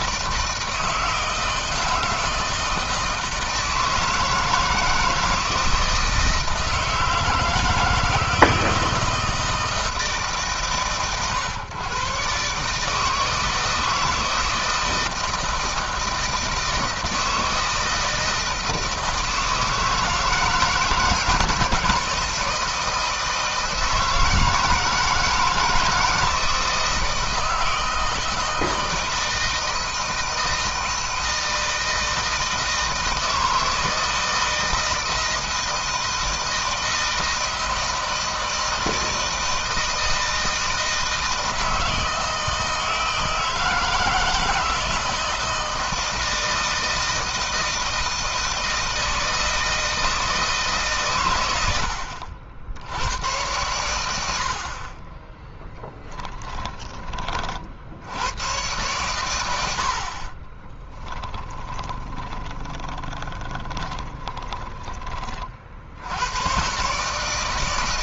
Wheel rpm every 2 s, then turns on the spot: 160, 160, 160, 160, 160, 140, 150, 160, 160, 160, 160, 170, 160, 160, 160, 160, 160, 160, 160, 160, 160, 160, 160, 160, 170, 150, 80, 40, 10, 110, 20, 20, 20, 120.
60-64